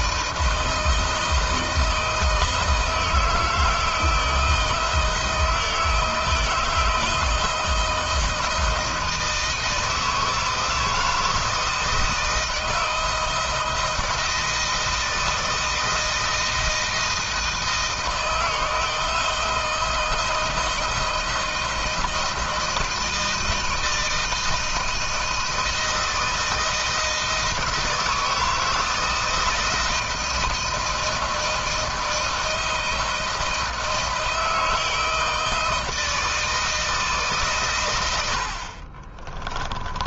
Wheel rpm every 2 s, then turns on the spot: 160, 160, 170, 160, 160, 160, 160, 160, 160, 160, 170, 160, 160, 170, 160, 160, 160, 160, 160, 50.
38-40